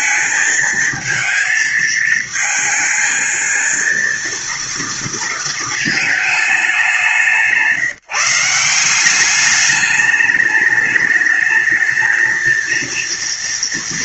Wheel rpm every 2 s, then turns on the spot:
220, 220, 230, 210, 170, 210, 220.
none